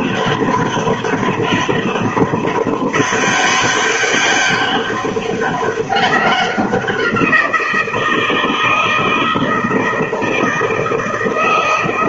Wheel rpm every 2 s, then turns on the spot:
200, 200, 200, 190, 160, 160.
none